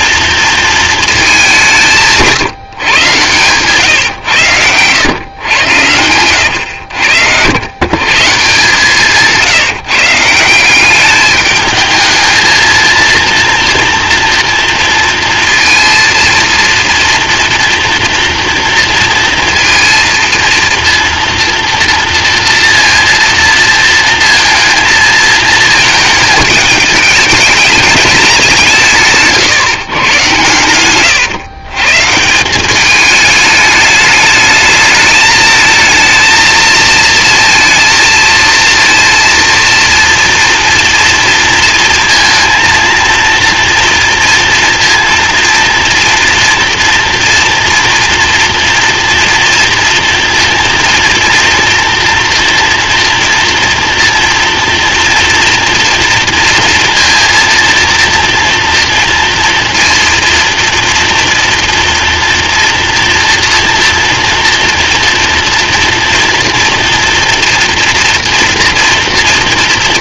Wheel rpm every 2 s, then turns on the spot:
230, 150, 100, 100, 150, 180, 230, 230, 230, 230, 230, 230, 230, 220, 170, 120, 180, 210, 220, 230, 230, 230, 230, 230, 230, 240, 240, 230, 230, 230, 230, 230, 230, 230, 230.
none